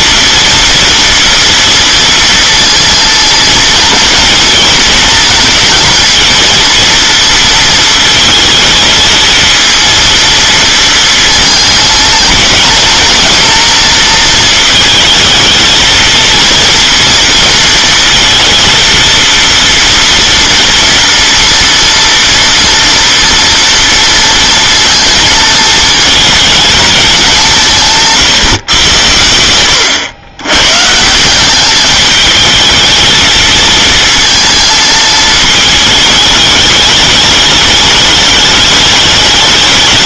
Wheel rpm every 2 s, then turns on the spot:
230, 230, 230, 230, 220, 230, 220, 230, 230, 230, 230, 230, 230, 220, 130, 130, 220, 220, 210, 210.
none